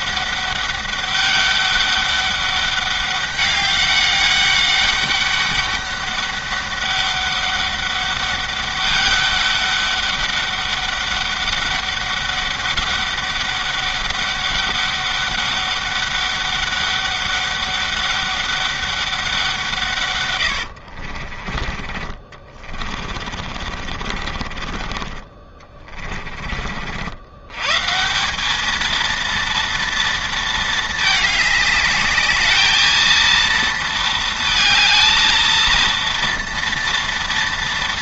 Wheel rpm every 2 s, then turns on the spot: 200, 200, 200, 200, 200, 200, 200, 200, 200, 200, 80, 40, 40, 50, 210, 220, 220, 220, 230.
20-26